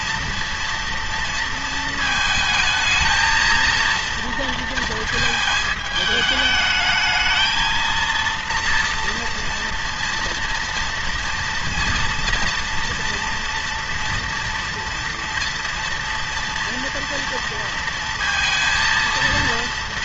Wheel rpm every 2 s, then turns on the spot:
230, 220, 220, 210, 230, 230, 230, 230, 230, 230.
none